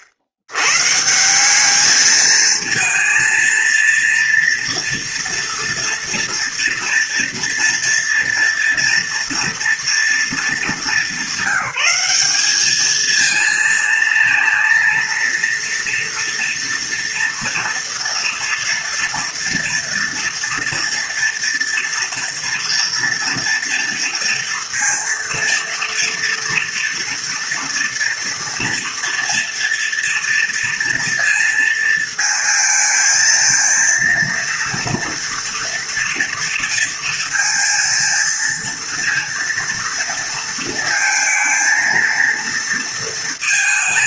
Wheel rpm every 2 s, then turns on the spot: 150, 230, 230, 230, 240, 200, 220, 230, 230, 230, 240, 240, 230, 230, 230, 230, 220, 230, 230, 230, 220, 230.
none